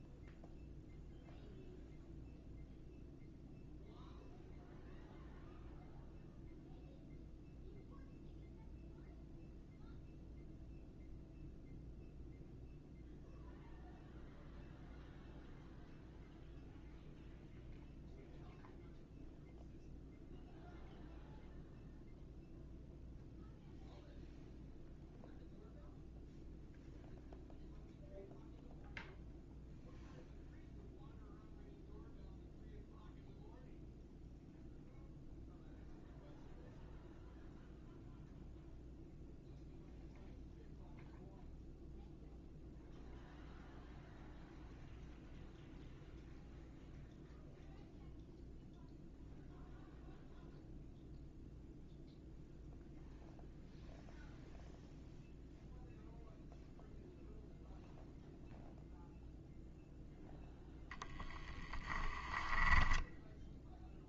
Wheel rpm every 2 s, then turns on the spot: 0, 0, 0, 0, 0, 0, 0, 0, 0, 0, 0, 0, 0, 0, 0, 0, 0, 0, 0, 0, 0, 0, 0, 0, 0, 0, 0, 0, 0, 0, 0, 10.
62-64